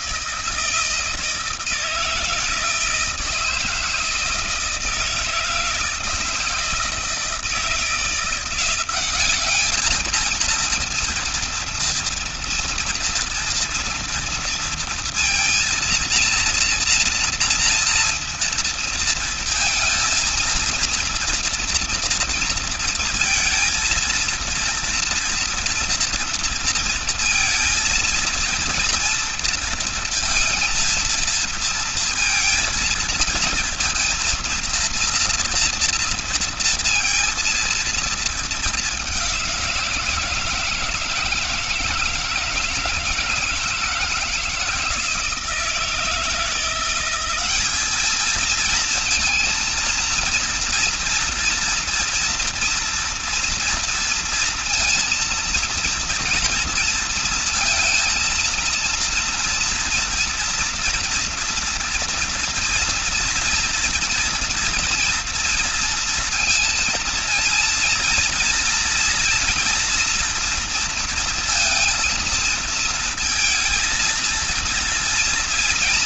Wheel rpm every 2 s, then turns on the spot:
160, 160, 160, 160, 180, 230, 230, 230, 230, 230, 230, 230, 230, 230, 230, 230, 230, 230, 230, 210, 160, 160, 170, 170, 220, 230, 240, 230, 230, 230, 230, 230, 230, 230, 230, 240, 230, 230.
none